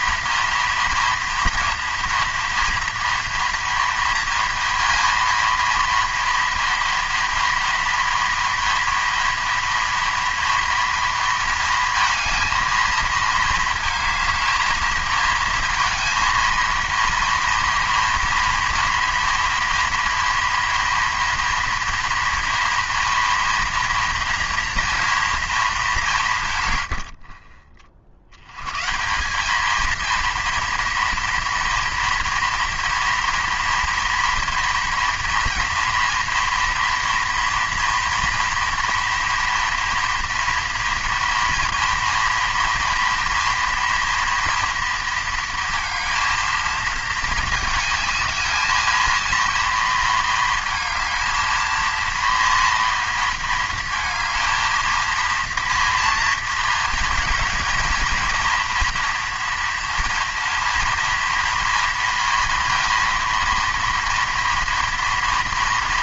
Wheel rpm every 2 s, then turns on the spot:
230, 240, 230, 230, 230, 230, 230, 220, 230, 230, 240, 230, 230, 120, 130, 230, 230, 230, 230, 230, 230, 230, 230, 220, 220, 220, 230, 230, 230, 240, 230, 230, 230.
none